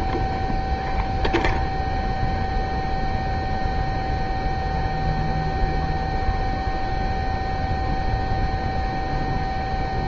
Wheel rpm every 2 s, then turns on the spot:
0, 0, 0, 0, 0.
none